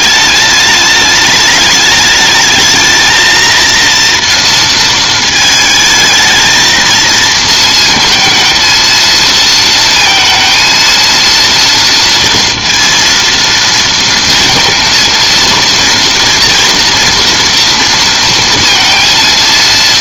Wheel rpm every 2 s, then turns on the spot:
210, 220, 230, 220, 230, 230, 230, 230, 230, 230.
none